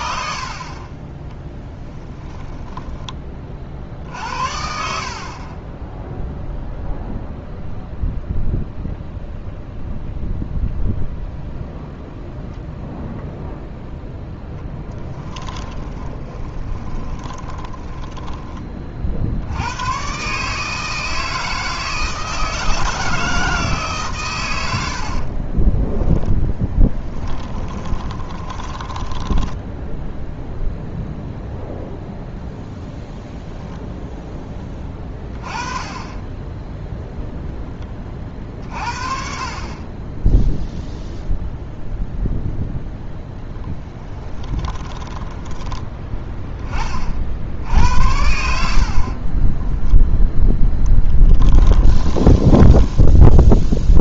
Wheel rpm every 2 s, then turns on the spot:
30, 20, 70, 0, 0, 0, 0, 10, 20, 40, 160, 160, 70, 10, 10, 0, 0, 20, 0, 50, 0, 10, 20, 30, 50, 10, 30.
14-18 24-30 44-46 50-54